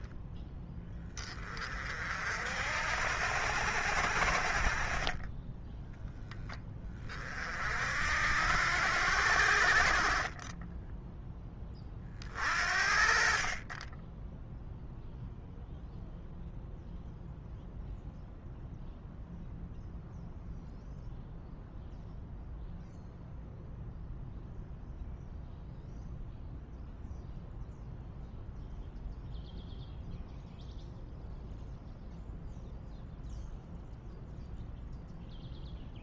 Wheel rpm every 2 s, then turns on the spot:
20, 60, 40, 20, 80, 10, 50, 0, 0, 0, 0, 0, 0, 0, 0, 0, 0, 0.
none